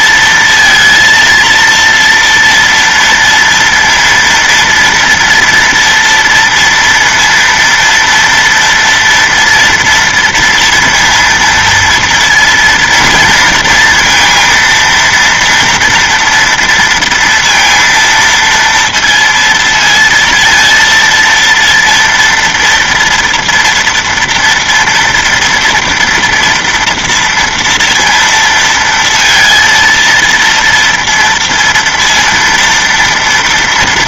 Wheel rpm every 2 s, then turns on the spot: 230, 230, 230, 230, 230, 230, 230, 230, 230, 230, 230, 230, 230, 240, 230, 230, 230.
none